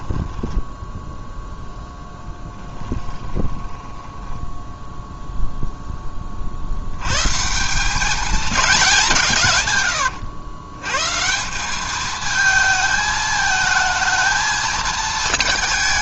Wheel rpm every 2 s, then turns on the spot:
10, 20, 0, 50, 210, 110, 220, 220.
0-4